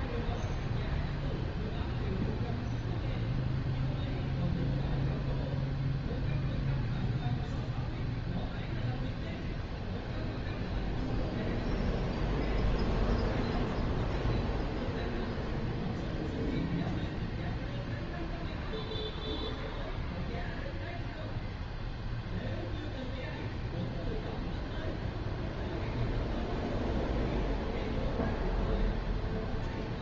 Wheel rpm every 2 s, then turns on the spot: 0, 0, 0, 0, 0, 0, 0, 0, 0, 0, 0, 0, 0, 0, 0.
none